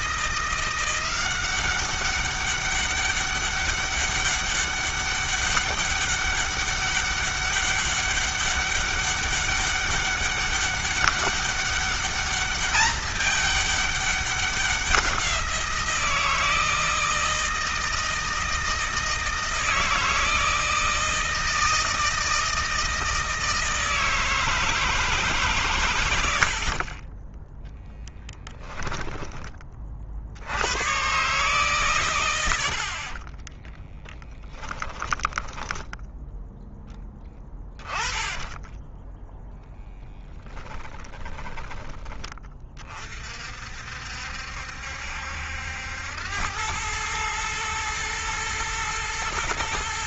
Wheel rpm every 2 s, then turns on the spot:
170, 200, 200, 200, 200, 200, 210, 190, 160, 160, 160, 160, 160, 50, 10, 110, 60, 20, 10, 10, 20, 30, 70, 100, 110.
28-30 34-36 38-42